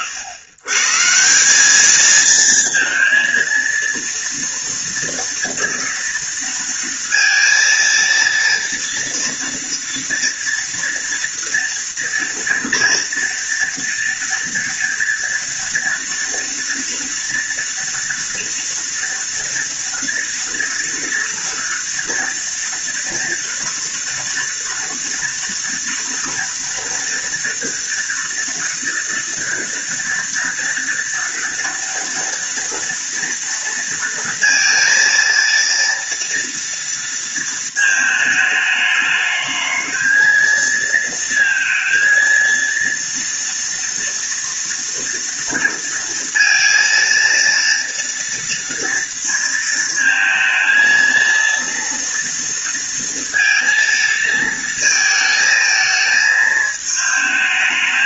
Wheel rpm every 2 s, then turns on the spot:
140, 230, 230, 230, 230, 240, 240, 230, 240, 230, 230, 240, 230, 230, 230, 230, 230, 230, 230, 220, 220, 230, 230, 230, 230, 230, 230, 230, 220.
none